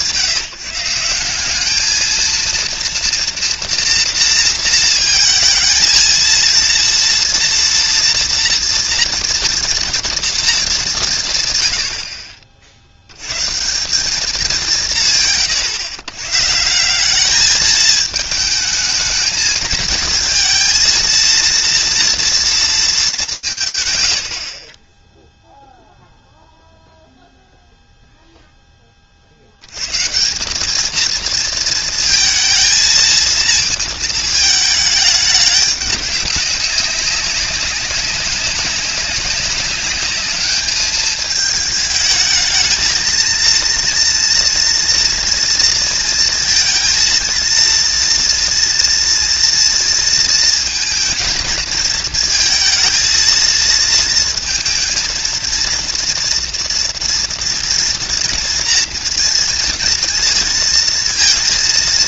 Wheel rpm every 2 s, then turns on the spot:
160, 230, 230, 230, 230, 210, 60, 180, 170, 220, 230, 210, 30, 0, 10, 210, 230, 210, 190, 200, 210, 220, 230, 230, 230, 230, 220, 230, 230, 230, 230.
none